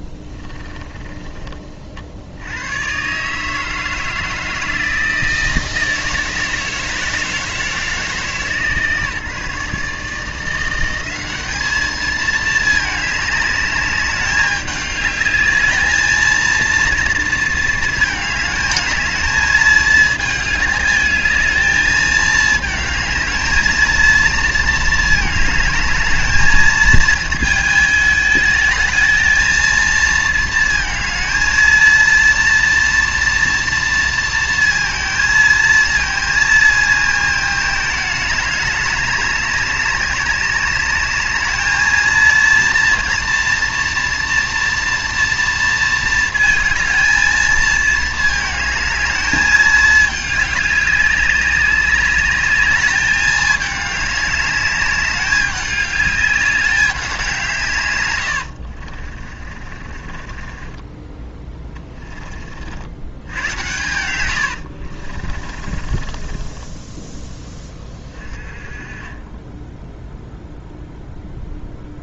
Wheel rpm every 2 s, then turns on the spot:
30, 100, 160, 160, 150, 170, 220, 200, 230, 210, 210, 220, 220, 220, 220, 220, 230, 230, 220, 200, 200, 230, 240, 220, 220, 200, 210, 200, 200, 60, 20, 50, 80, 10, 30, 0.
0-2 58-62 64-66